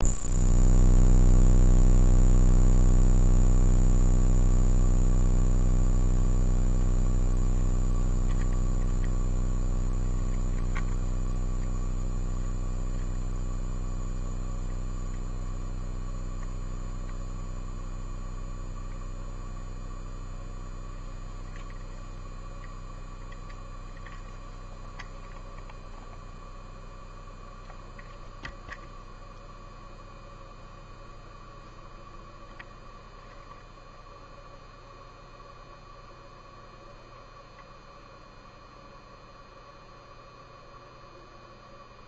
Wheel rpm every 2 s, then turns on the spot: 0, 0, 0, 0, 0, 0, 0, 0, 0, 0, 0, 0, 0, 0, 0, 0, 0, 0, 0, 0, 0.
none